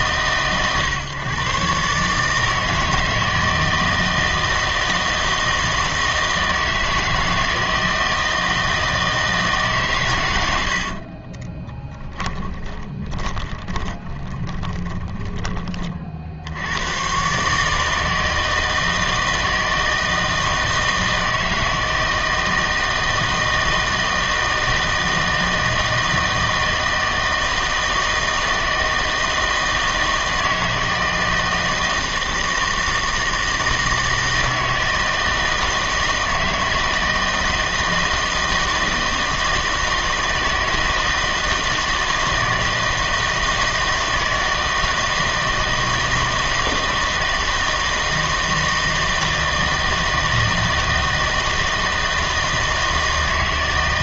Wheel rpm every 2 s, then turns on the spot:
130, 160, 160, 160, 160, 90, 20, 20, 80, 160, 160, 160, 160, 160, 160, 160, 160, 160, 160, 160, 160, 160, 160, 160, 160, 160, 160.
12-16